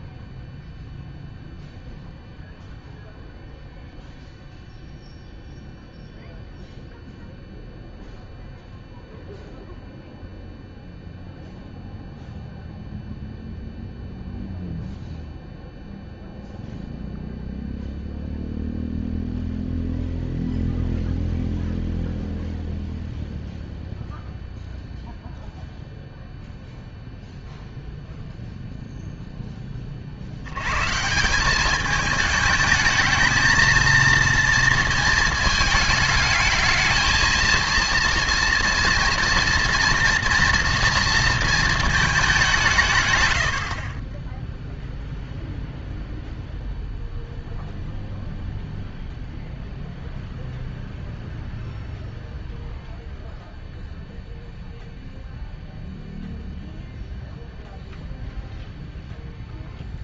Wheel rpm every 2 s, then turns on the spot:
0, 0, 0, 0, 0, 0, 0, 0, 0, 0, 0, 0, 0, 0, 0, 110, 220, 230, 220, 230, 230, 180, 0, 0, 0, 0, 0, 0, 0, 0.
none